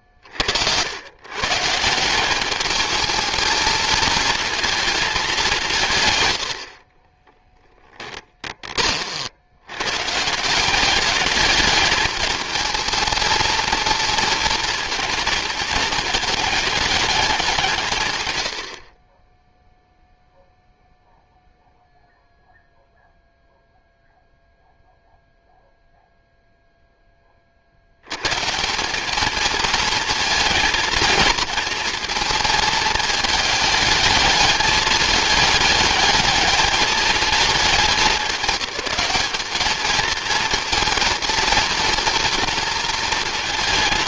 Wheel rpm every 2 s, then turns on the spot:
90, 210, 230, 50, 30, 200, 220, 230, 210, 50, 0, 0, 0, 0, 180, 230, 220, 210, 210, 200, 220, 230.
6-8